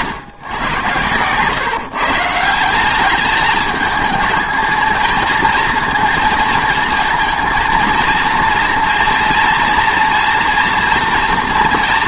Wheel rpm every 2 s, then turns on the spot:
110, 180, 220, 230, 230, 230.
none